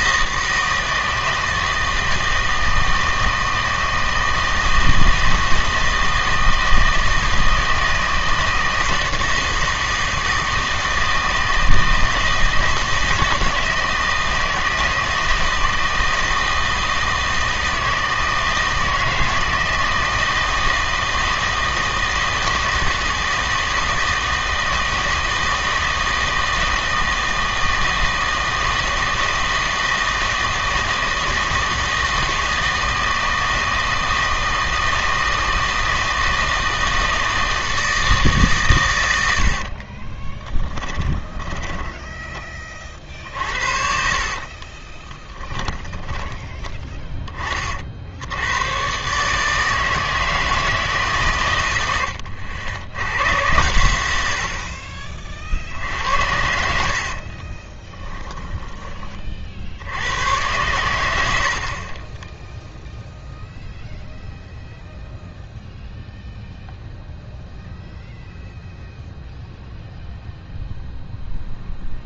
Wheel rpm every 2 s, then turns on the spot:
160, 160, 160, 160, 160, 160, 160, 160, 160, 160, 160, 160, 160, 160, 160, 160, 160, 160, 160, 110, 10, 30, 30, 20, 110, 160, 90, 50, 70, 20, 110, 0, 0, 0, 0, 0.
40-42 44-46 56-58